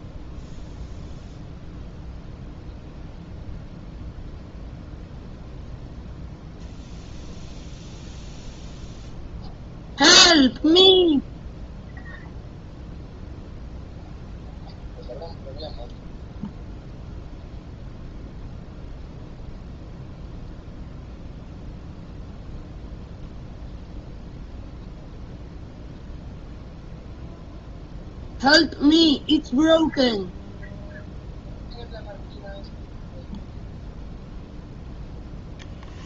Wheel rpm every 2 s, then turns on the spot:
0, 0, 0, 0, 0, 0, 0, 0, 0, 0, 0, 0, 0, 0, 0, 0, 0, 0.
none